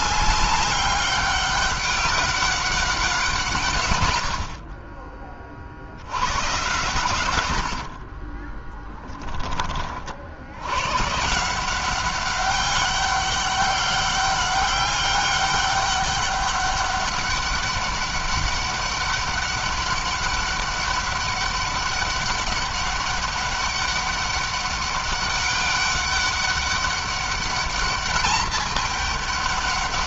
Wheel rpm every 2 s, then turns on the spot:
200, 200, 40, 120, 20, 130, 200, 200, 200, 200, 200, 200, 200, 200, 210.
8-10